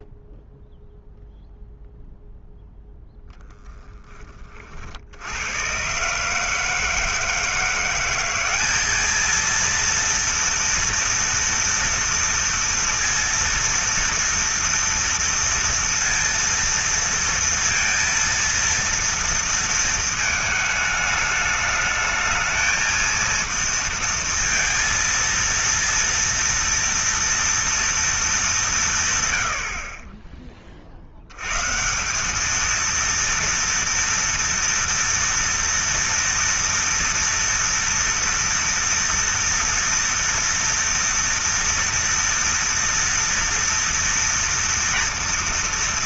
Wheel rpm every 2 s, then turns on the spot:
0, 0, 30, 150, 190, 230, 230, 230, 230, 230, 220, 220, 230, 230, 210, 40, 210, 230, 230, 230, 230, 230, 230.
none